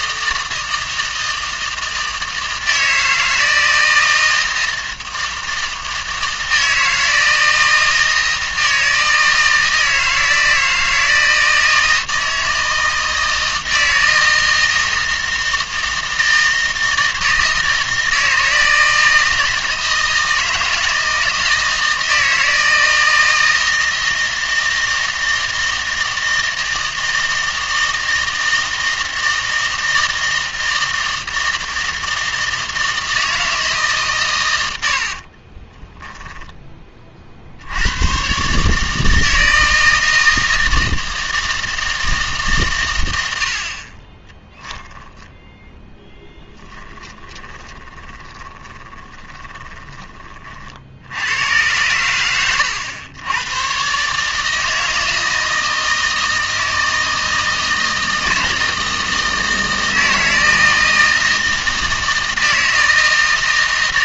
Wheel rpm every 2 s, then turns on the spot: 160, 160, 160, 160, 160, 160, 160, 160, 160, 160, 160, 160, 160, 160, 160, 160, 160, 90, 20, 150, 160, 120, 10, 10, 20, 50, 100, 160, 160, 160, 160, 160.
34-36 46-50